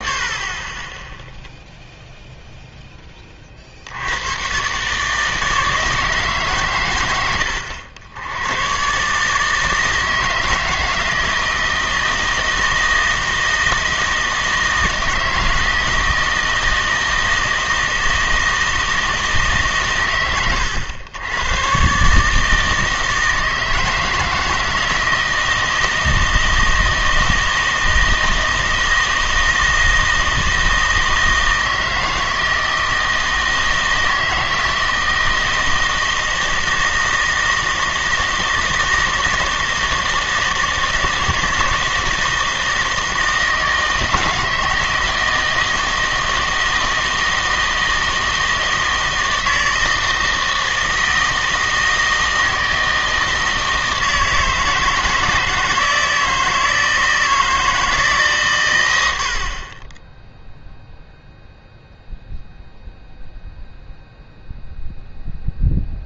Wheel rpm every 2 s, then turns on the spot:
20, 0, 130, 120, 110, 160, 160, 160, 160, 160, 100, 160, 160, 160, 160, 160, 160, 160, 160, 160, 160, 160, 160, 160, 160, 160, 160, 160, 160, 110, 0, 0, 0.
none